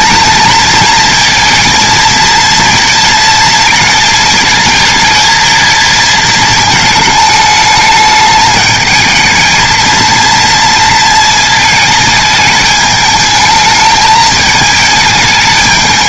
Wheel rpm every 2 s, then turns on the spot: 220, 230, 220, 220, 220, 230, 220, 220.
none